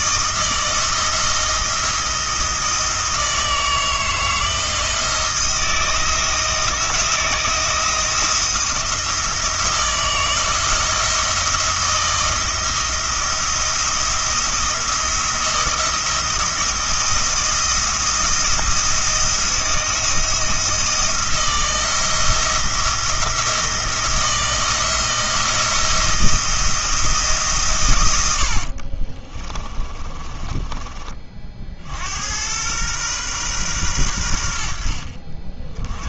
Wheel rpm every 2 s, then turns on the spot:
160, 160, 160, 170, 170, 160, 170, 170, 170, 170, 170, 170, 170, 170, 60, 20, 110, 70.
28-30